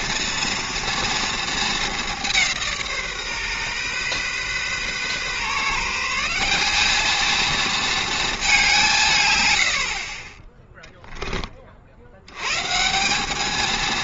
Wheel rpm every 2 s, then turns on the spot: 240, 170, 130, 200, 190, 10, 140.
none